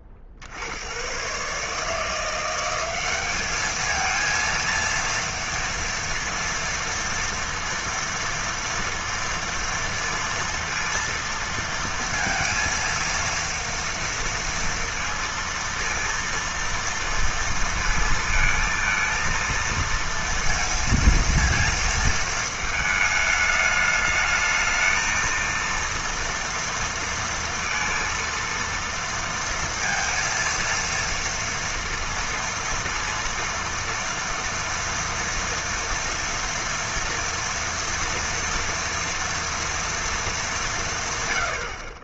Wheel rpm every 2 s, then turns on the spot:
80, 180, 230, 230, 230, 230, 230, 230, 230, 230, 230, 220, 220, 230, 230, 230, 230, 230, 230, 230, 230.
none